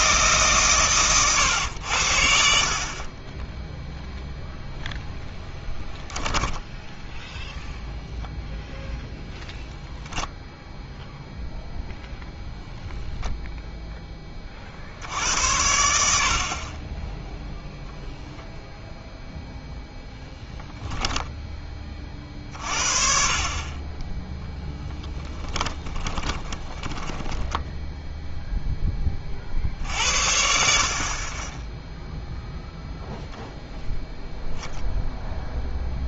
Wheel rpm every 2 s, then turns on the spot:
130, 50, 0, 10, 0, 0, 0, 50, 30, 0, 0, 40, 10, 10, 10, 60, 0, 0.
26-28